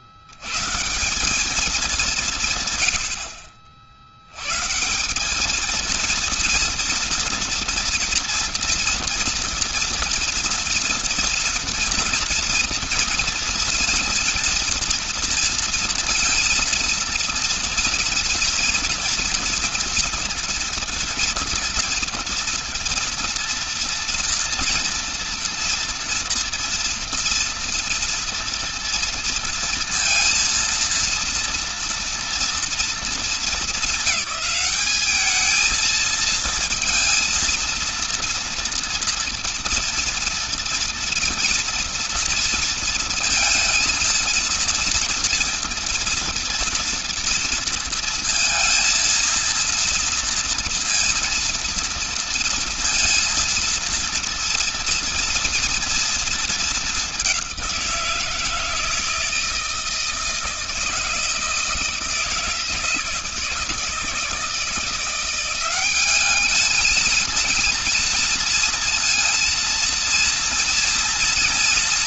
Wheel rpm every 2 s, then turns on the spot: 120, 160, 120, 230, 230, 230, 230, 230, 230, 230, 240, 230, 240, 230, 230, 230, 230, 210, 230, 230, 230, 230, 230, 240, 230, 230, 230, 230, 210, 160, 160, 160, 170, 220, 230, 240.
none